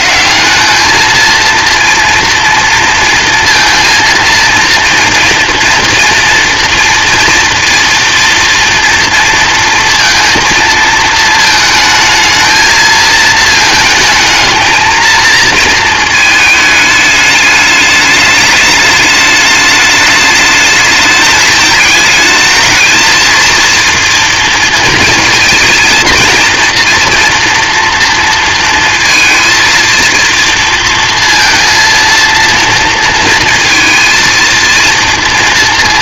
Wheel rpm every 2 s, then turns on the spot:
160, 230, 230, 230, 230, 230, 220, 220, 220, 210, 210, 220, 230, 230, 230, 230, 230, 230.
none